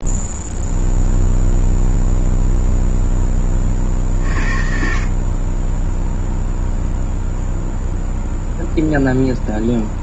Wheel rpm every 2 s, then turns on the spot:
0, 0, 40, 0, 0.
none